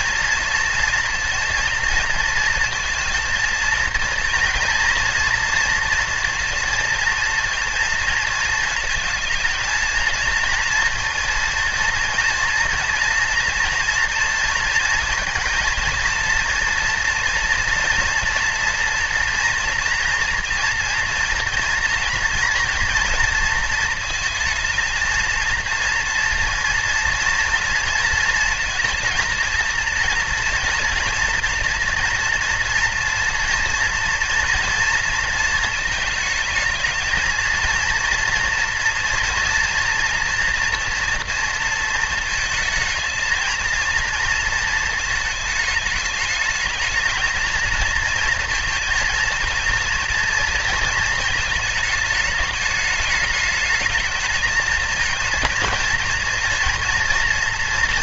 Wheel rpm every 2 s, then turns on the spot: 230, 230, 230, 230, 220, 230, 230, 230, 240, 230, 230, 230, 220, 230, 230, 230, 230, 230, 220, 230, 240, 220, 230, 220, 230, 230, 210, 220, 230.
none